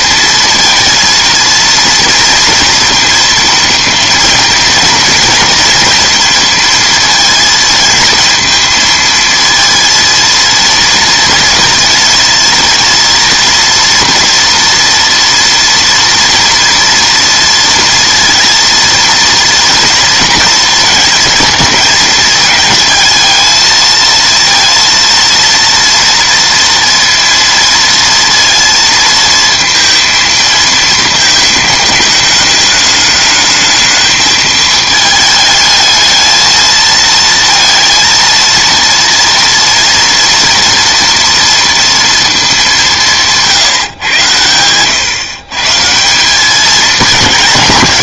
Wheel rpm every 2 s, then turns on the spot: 230, 230, 230, 230, 230, 230, 230, 240, 230, 230, 230, 220, 230, 230, 230, 220, 210, 220, 220, 230, 230, 190, 120, 210.
none